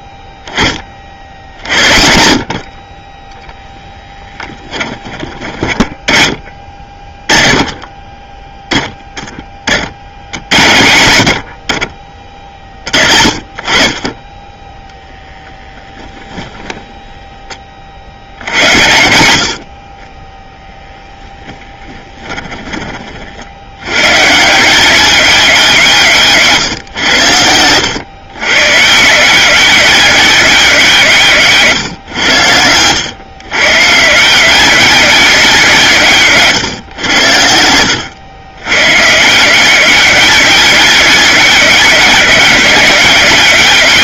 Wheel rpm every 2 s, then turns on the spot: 30, 40, 20, 30, 10, 90, 40, 10, 10, 80, 10, 30, 180, 140, 130, 180, 100, 200, 140, 130, 200, 190.
4-6 26-28 36-38